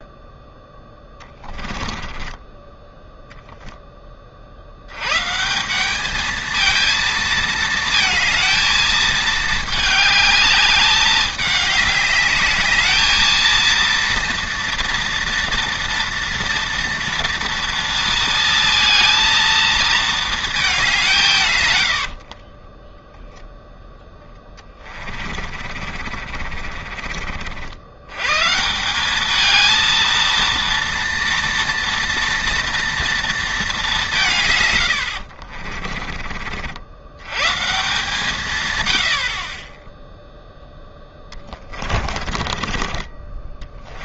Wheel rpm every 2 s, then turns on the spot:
10, 10, 70, 230, 220, 210, 210, 230, 230, 220, 200, 20, 20, 40, 170, 230, 230, 130, 70, 120, 0, 30.
0-4 22-28 42-44